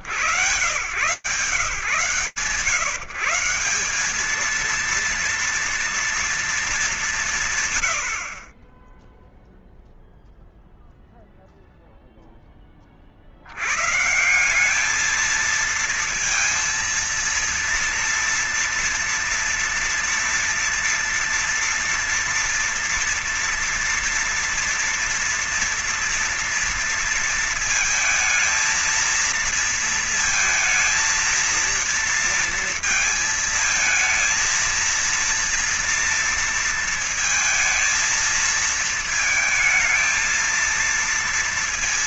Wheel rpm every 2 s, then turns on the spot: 140, 170, 230, 130, 0, 0, 100, 230, 230, 230, 240, 230, 240, 230, 230, 230, 220, 230, 230, 220, 230.
none